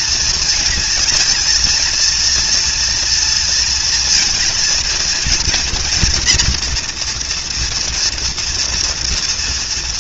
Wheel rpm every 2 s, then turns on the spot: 230, 230, 230, 240, 230.
none